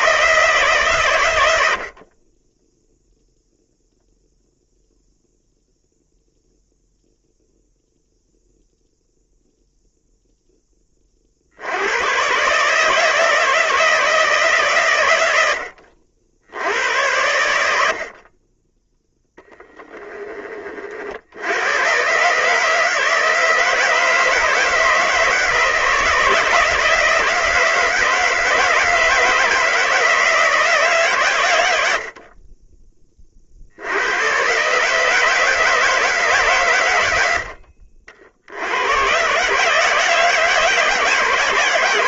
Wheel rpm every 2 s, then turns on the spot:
140, 0, 0, 0, 0, 10, 150, 130, 80, 10, 40, 150, 160, 160, 160, 150, 20, 140, 110, 100, 160.
none